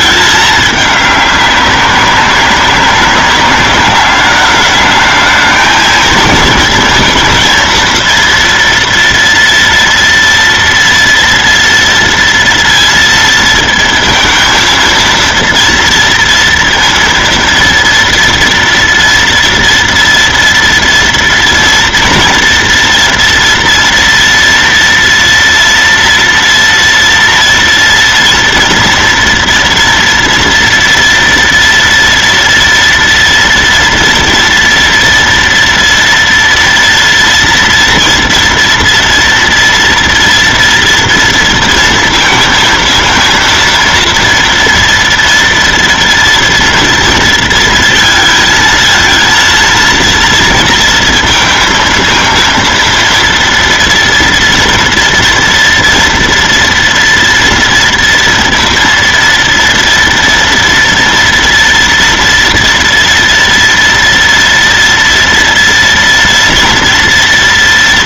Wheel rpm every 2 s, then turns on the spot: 210, 190, 210, 230, 230, 230, 230, 230, 230, 230, 230, 240, 230, 240, 230, 240, 230, 230, 230, 230, 230, 230, 230, 230, 230, 230, 230, 230, 230, 230, 240, 230, 230, 230.
none